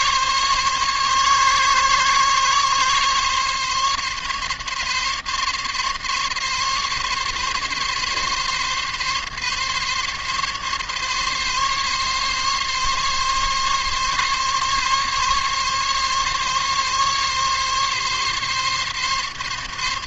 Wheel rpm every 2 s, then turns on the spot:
140, 140, 140, 140, 140, 140, 140, 140, 140, 140.
none